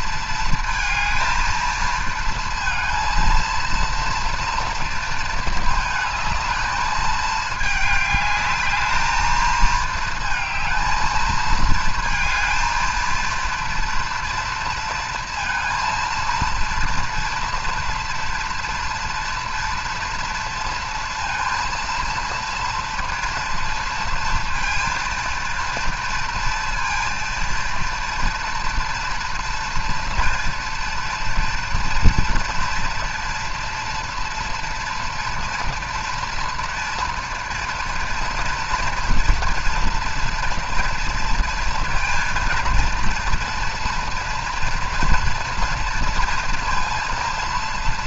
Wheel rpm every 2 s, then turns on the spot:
230, 230, 230, 220, 210, 220, 230, 230, 230, 230, 230, 230, 230, 230, 230, 230, 230, 230, 240, 240, 230, 230, 240, 230.
none